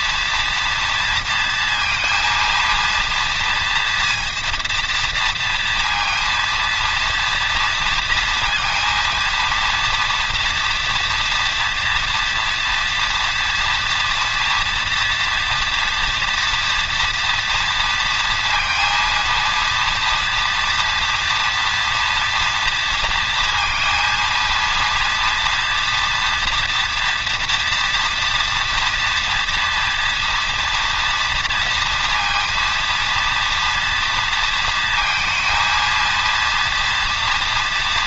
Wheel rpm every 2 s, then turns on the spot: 230, 230, 230, 230, 230, 230, 230, 240, 230, 230, 230, 230, 230, 230, 230, 230, 230, 230, 230.
none